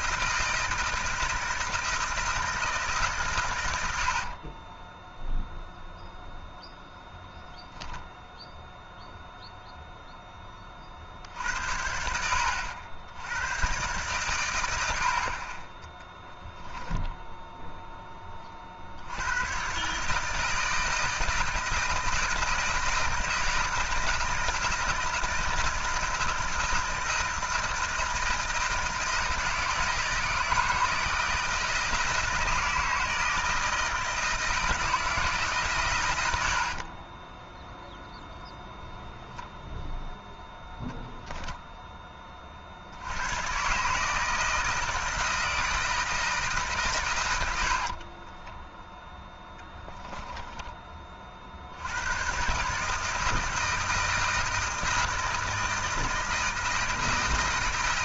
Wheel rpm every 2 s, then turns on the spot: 160, 140, 10, 0, 0, 40, 80, 80, 10, 70, 160, 160, 160, 160, 160, 160, 160, 160, 50, 0, 0, 60, 160, 130, 0, 20, 150, 160, 160.
4-6 16-18 36-38